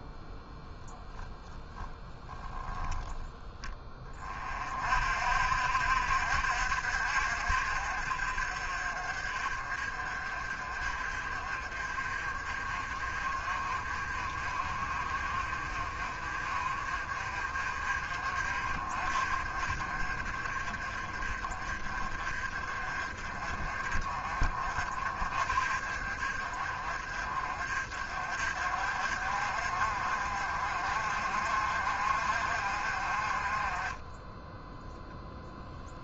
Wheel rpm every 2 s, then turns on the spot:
0, 10, 50, 60, 40, 40, 40, 40, 40, 40, 40, 40, 40, 40, 50, 50, 40, 0.
2-4